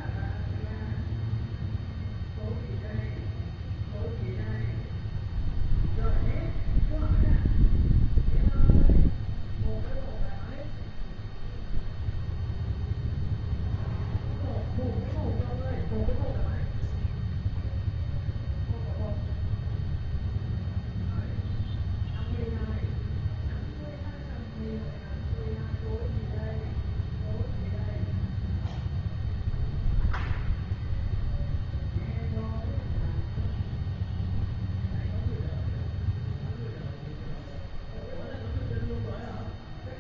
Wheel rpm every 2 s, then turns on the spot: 0, 0, 0, 0, 0, 0, 0, 0, 0, 0, 0, 0, 0, 0, 0, 0, 0, 0, 0, 0.
none